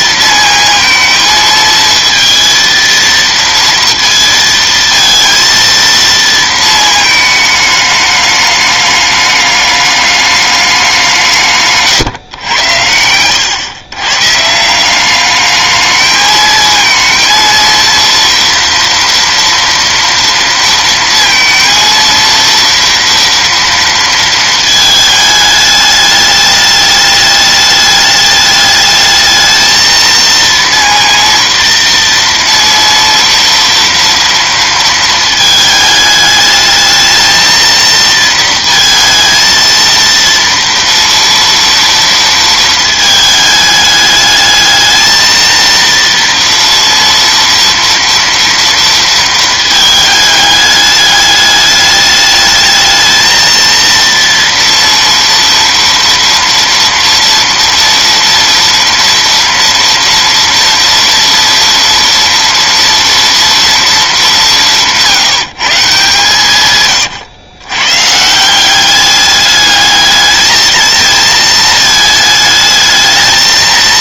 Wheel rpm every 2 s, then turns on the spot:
230, 230, 230, 220, 210, 170, 110, 190, 230, 230, 230, 230, 220, 210, 220, 230, 230, 220, 220, 230, 230, 220, 220, 230, 230, 210, 220, 230, 230, 230, 240, 230, 150, 110, 200, 220, 220.
none